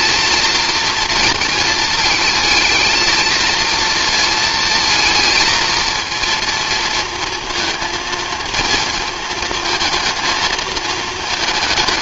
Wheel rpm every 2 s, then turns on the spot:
230, 220, 230, 230, 220, 220.
none